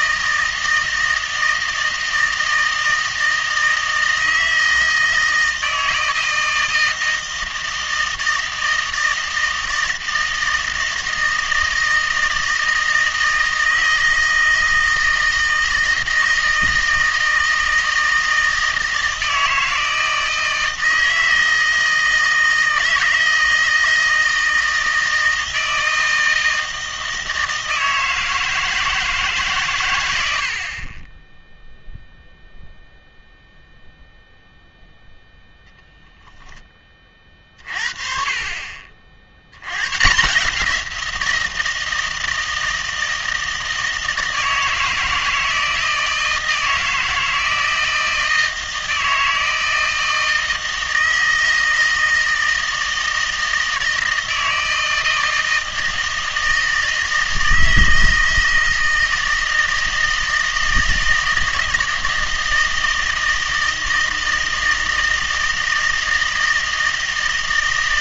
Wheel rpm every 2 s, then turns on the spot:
160, 160, 160, 160, 160, 160, 160, 160, 160, 160, 160, 160, 160, 160, 160, 50, 0, 0, 20, 40, 170, 160, 160, 160, 160, 160, 160, 160, 160, 160, 160, 160, 160, 160.
none